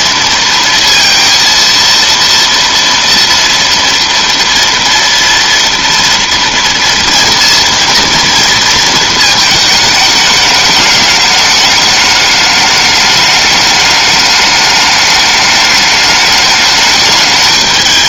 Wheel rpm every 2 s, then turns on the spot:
230, 230, 230, 230, 230, 210, 210, 210, 210.
none